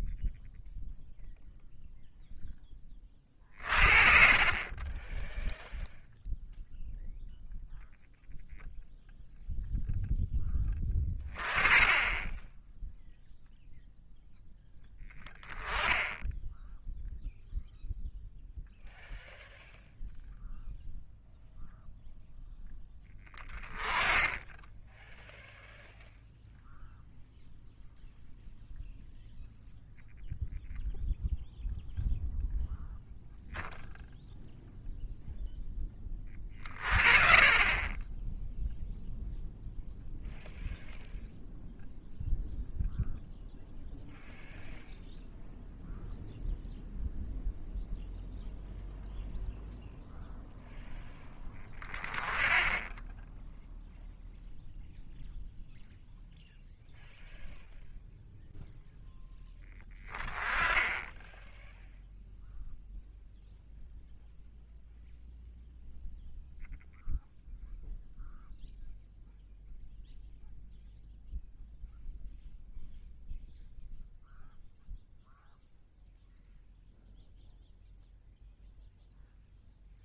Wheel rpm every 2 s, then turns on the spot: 0, 30, 10, 0, 0, 10, 0, 10, 0, 0, 0, 10, 10, 0, 0, 0, 0, 0, 30, 0, 0, 0, 0, 0, 0, 0, 10, 0, 0, 0, 10, 0, 0, 0, 0, 0, 0, 0, 0, 0.
none